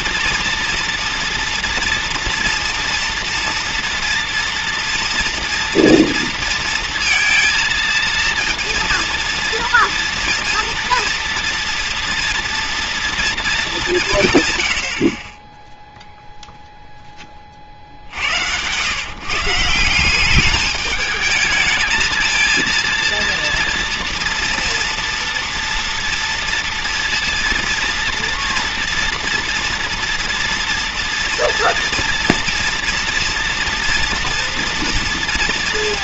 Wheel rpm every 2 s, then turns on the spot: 240, 230, 240, 230, 230, 230, 230, 130, 0, 90, 200, 230, 230, 230, 230, 240, 230, 240.
none